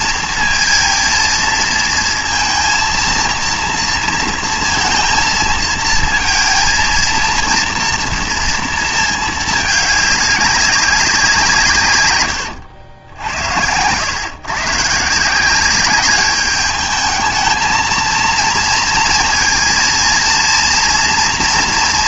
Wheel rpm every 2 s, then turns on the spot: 230, 230, 230, 230, 230, 200, 90, 140, 210, 230, 230.
none